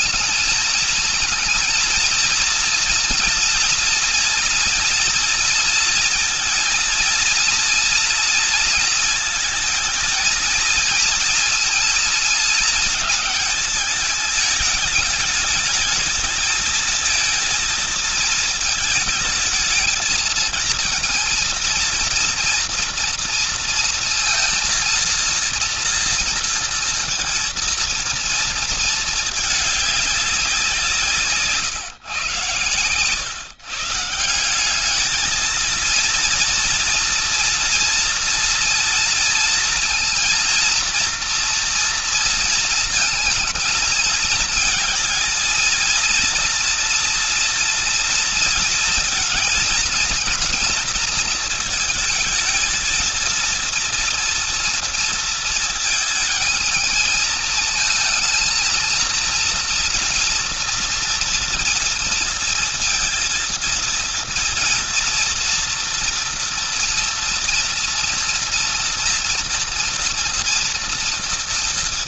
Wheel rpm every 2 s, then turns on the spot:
230, 230, 230, 230, 230, 230, 220, 210, 220, 220, 230, 230, 230, 230, 230, 190, 110, 170, 230, 230, 230, 230, 230, 230, 230, 230, 220, 230, 220, 230, 230, 230, 230, 230, 230, 230.
none